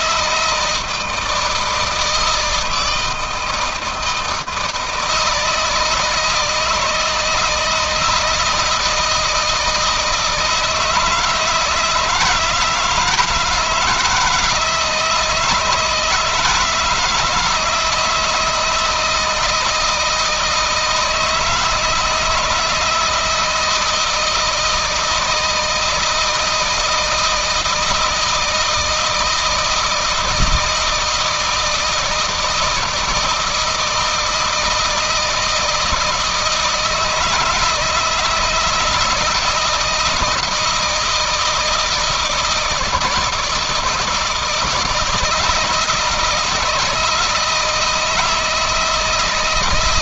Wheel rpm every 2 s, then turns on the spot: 160, 160, 160, 160, 160, 160, 170, 170, 160, 160, 160, 160, 170, 160, 160, 160, 160, 160, 160, 160, 160, 160, 160, 160, 160.
none